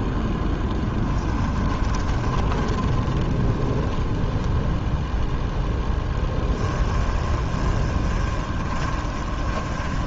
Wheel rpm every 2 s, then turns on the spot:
10, 20, 0, 20, 30.
0-4 6-10